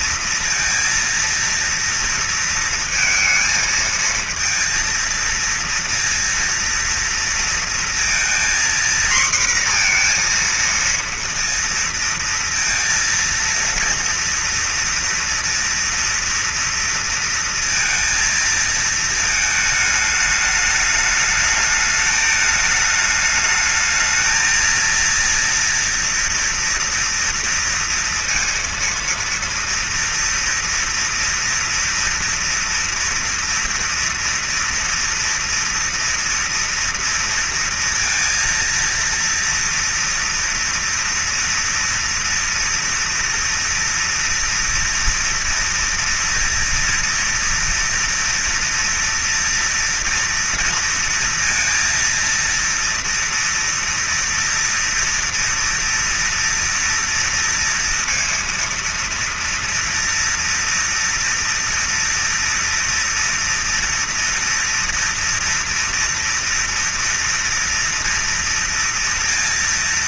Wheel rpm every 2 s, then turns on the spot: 230, 230, 230, 230, 240, 230, 230, 230, 230, 220, 210, 210, 230, 230, 230, 230, 240, 230, 230, 230, 230, 230, 230, 230, 230, 230, 230, 240, 230, 230, 230, 230, 230, 230, 230.
none